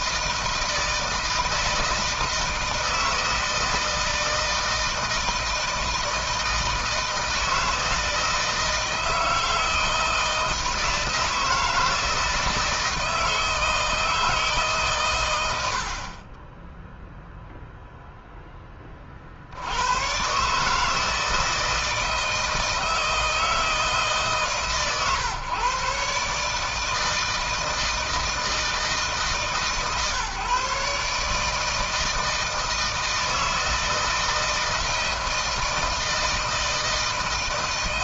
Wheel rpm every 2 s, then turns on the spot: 160, 160, 160, 160, 160, 160, 160, 150, 20, 10, 140, 160, 140, 150, 160, 140, 160, 160, 160.
none